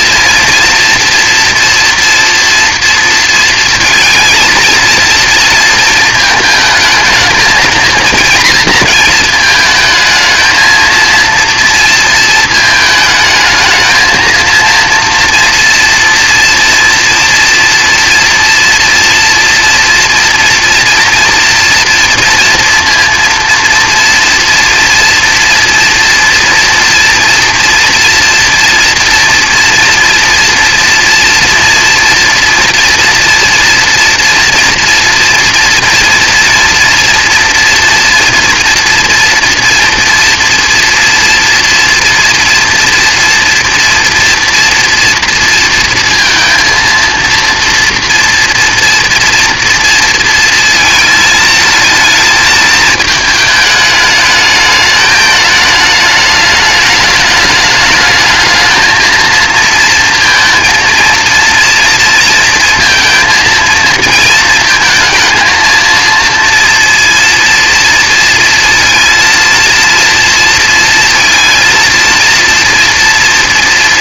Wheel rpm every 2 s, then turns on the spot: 230, 230, 230, 220, 230, 230, 220, 230, 230, 230, 230, 230, 230, 230, 230, 230, 230, 230, 230, 230, 240, 230, 230, 230, 240, 230, 220, 210, 210, 220, 230, 230, 230, 230, 230, 230, 230.
none